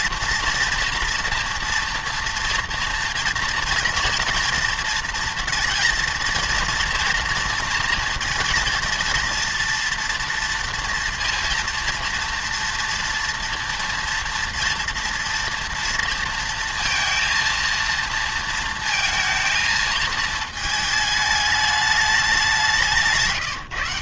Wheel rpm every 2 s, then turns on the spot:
240, 230, 230, 230, 230, 230, 230, 230, 230, 230, 220, 180.
none